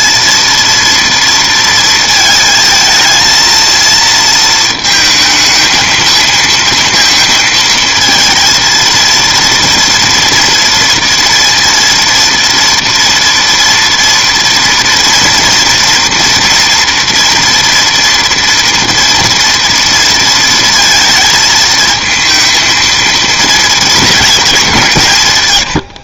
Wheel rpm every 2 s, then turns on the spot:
230, 220, 230, 230, 230, 230, 230, 230, 230, 240, 230, 230, 190.
none